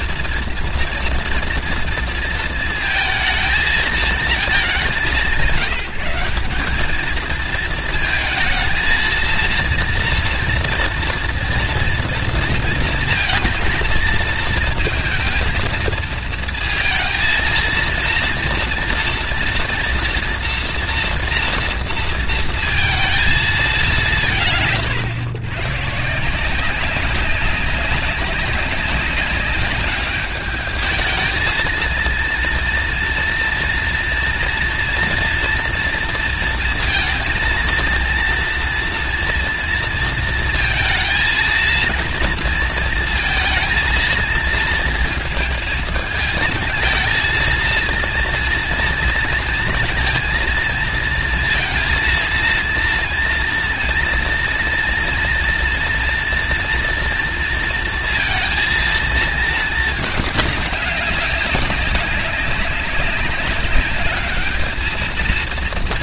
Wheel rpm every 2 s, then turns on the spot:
230, 220, 190, 200, 230, 240, 230, 230, 220, 230, 230, 230, 150, 190, 200, 210, 230, 230, 230, 230, 230, 230, 230, 230, 230, 230, 230, 230, 230, 230, 200, 200, 210.
none